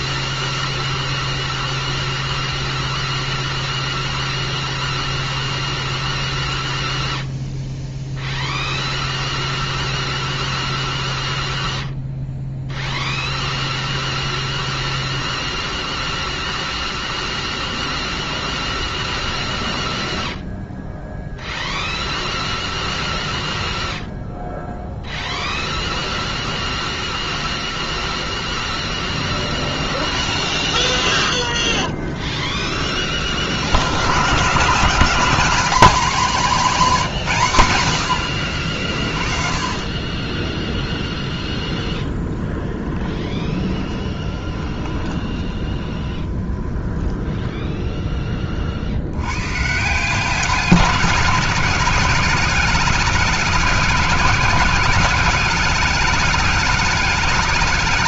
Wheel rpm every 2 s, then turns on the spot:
0, 0, 0, 0, 0, 0, 0, 0, 0, 0, 0, 0, 0, 0, 0, 10, 20, 150, 220, 50, 20, 20, 20, 10, 20, 180, 200, 190, 210.
30-32 40-48